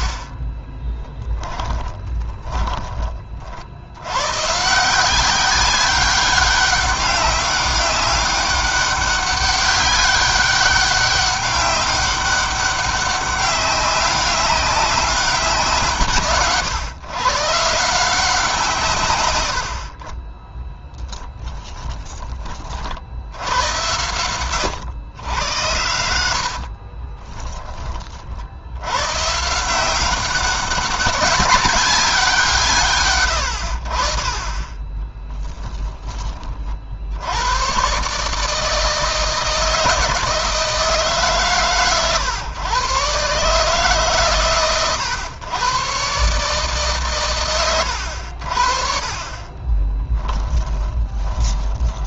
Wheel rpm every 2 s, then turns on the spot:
30, 20, 150, 200, 200, 200, 200, 200, 140, 150, 10, 40, 110, 60, 100, 190, 140, 20, 50, 160, 150, 120, 120, 140, 50, 20.
0-2 20-22 26-28 50-52